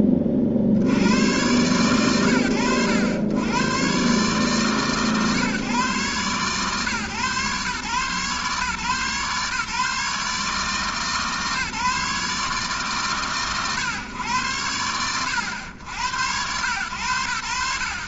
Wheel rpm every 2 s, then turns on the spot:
60, 90, 130, 130, 140, 150, 130, 90, 110.
none